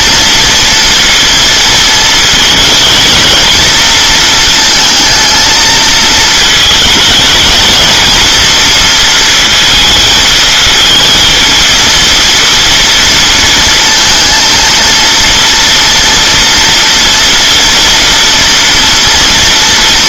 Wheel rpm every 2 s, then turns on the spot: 230, 220, 230, 220, 230, 230, 230, 230, 230, 230.
none